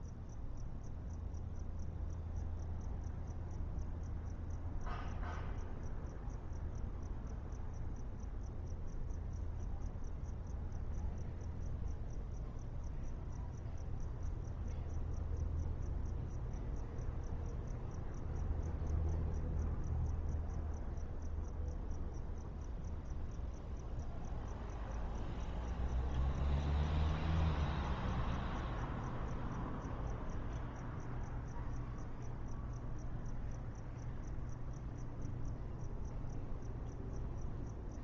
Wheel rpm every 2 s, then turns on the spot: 0, 0, 0, 0, 0, 0, 0, 0, 0, 0, 0, 0, 0, 0, 0, 0, 0, 0, 0.
none